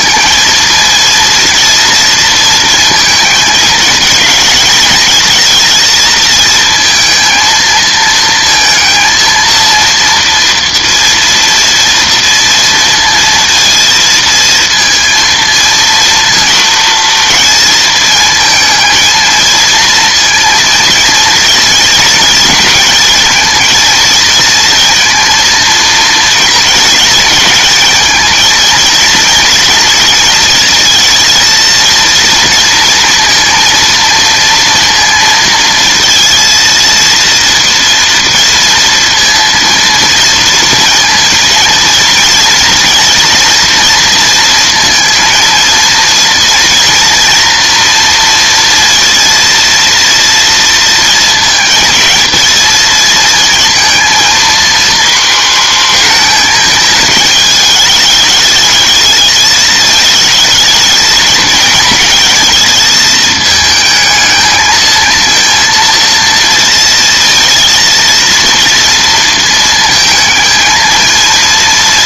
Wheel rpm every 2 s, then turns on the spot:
230, 230, 220, 230, 230, 230, 230, 230, 230, 220, 230, 230, 230, 220, 230, 230, 230, 230, 230, 230, 230, 230, 230, 230, 230, 230, 220, 230, 220, 220, 220, 220, 220, 230, 230, 220.
none